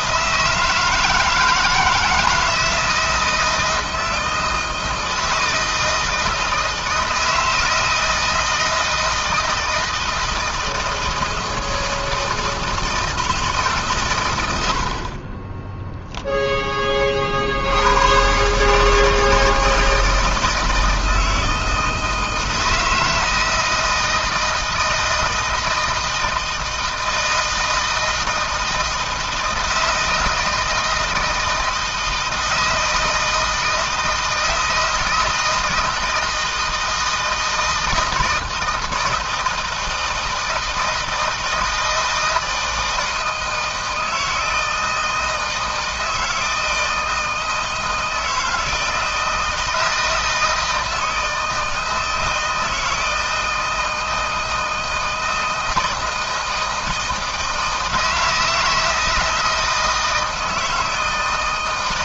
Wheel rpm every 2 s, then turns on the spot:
160, 160, 160, 160, 160, 160, 160, 60, 20, 150, 160, 160, 160, 160, 160, 160, 160, 160, 160, 160, 160, 160, 160, 160, 160, 160, 160, 160, 160, 160, 160.
none